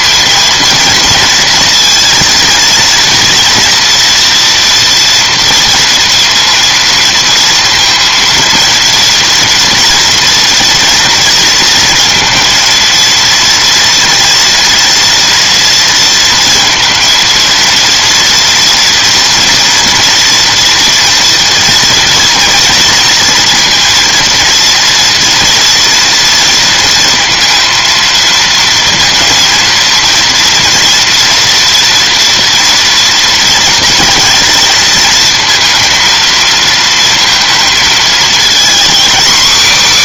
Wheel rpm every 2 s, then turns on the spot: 230, 230, 230, 230, 230, 230, 230, 230, 230, 240, 240, 240, 230, 230, 230, 230, 230, 220, 230, 250.
none